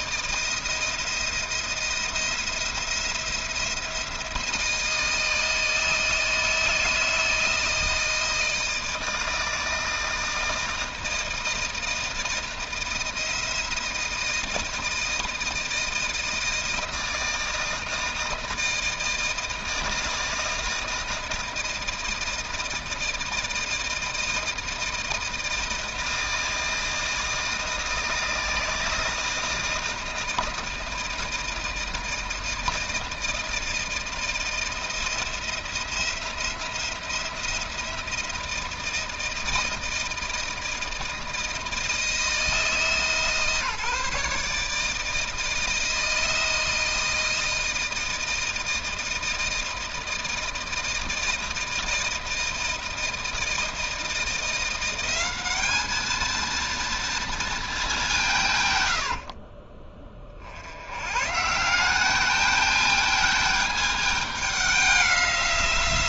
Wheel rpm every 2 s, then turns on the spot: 170, 170, 160, 160, 160, 160, 160, 160, 160, 160, 160, 160, 160, 160, 160, 160, 160, 170, 170, 170, 160, 160, 150, 160, 160, 160, 160, 180, 230, 140, 70, 210, 200.
none